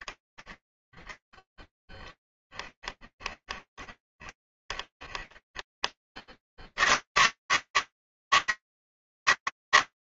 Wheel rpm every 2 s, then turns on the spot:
20, 20, 20, 50, 160.
0-6